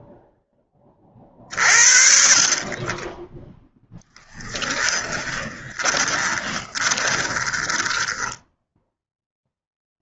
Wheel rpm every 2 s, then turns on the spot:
0, 60, 10, 20, 10.
6-8